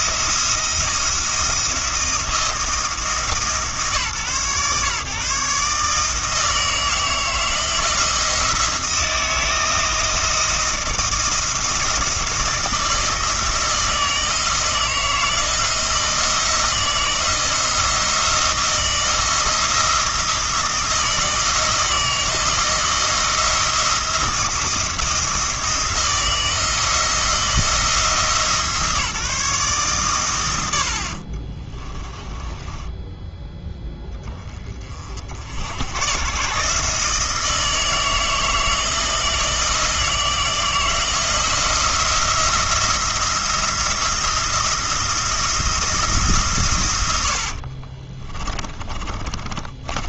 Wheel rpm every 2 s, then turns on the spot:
170, 170, 140, 160, 160, 160, 160, 160, 170, 160, 160, 170, 170, 170, 160, 70, 10, 40, 150, 170, 170, 170, 170, 120, 30.
32-34 48-50